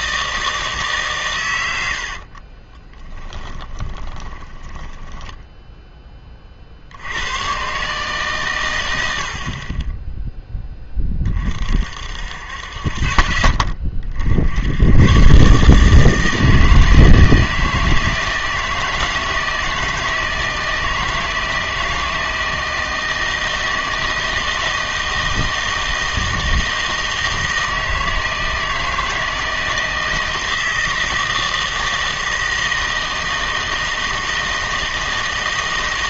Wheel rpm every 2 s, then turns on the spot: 150, 20, 10, 60, 110, 10, 50, 100, 160, 160, 160, 160, 160, 160, 160, 160, 160, 160.
2-6